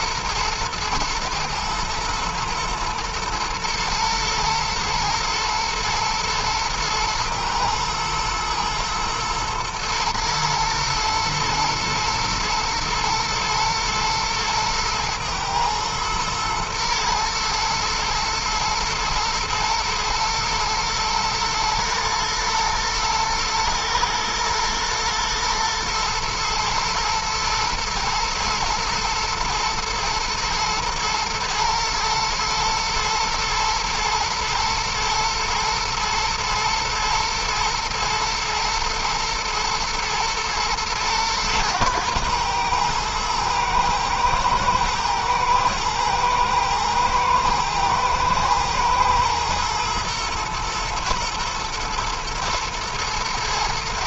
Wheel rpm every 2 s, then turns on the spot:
110, 110, 120, 110, 120, 120, 110, 110, 110, 110, 110, 110, 110, 120, 120, 120, 110, 120, 110, 110, 110, 110, 110, 110, 110, 110, 110.
none